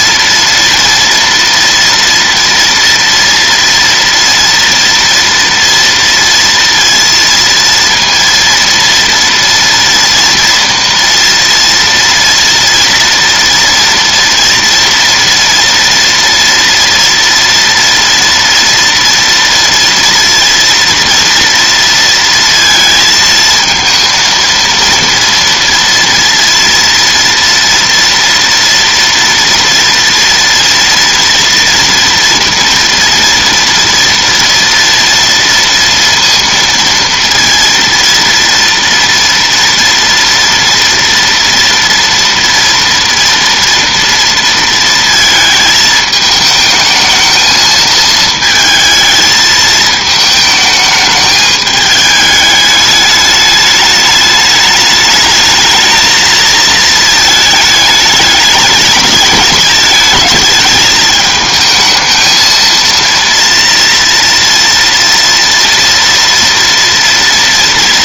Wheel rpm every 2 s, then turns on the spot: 230, 230, 230, 230, 230, 230, 230, 230, 230, 230, 230, 230, 230, 230, 230, 230, 230, 230, 230, 230, 230, 230, 230, 220, 220, 220, 210, 210, 220, 210, 220, 230, 230, 230.
none